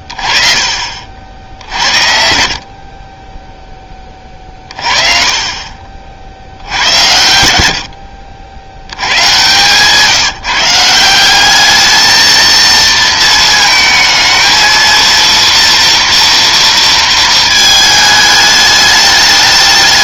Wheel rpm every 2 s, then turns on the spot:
30, 50, 30, 80, 80, 160, 230, 220, 230, 210.
none